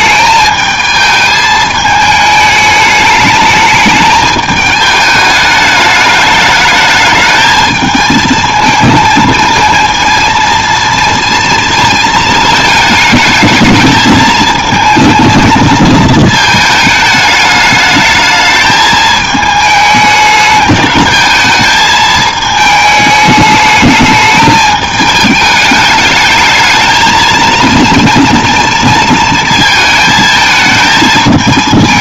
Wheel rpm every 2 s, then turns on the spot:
220, 210, 210, 210, 220, 230, 220, 220, 220, 220, 210, 220, 210, 220, 230, 220.
none